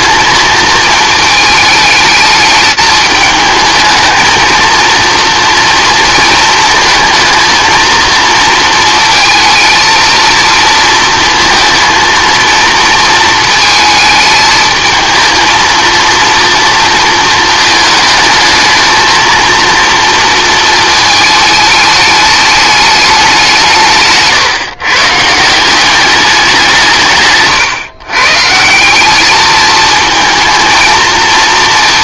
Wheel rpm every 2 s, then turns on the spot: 220, 210, 230, 220, 230, 230, 230, 220, 230, 220, 230, 210, 130, 180, 160, 230.
none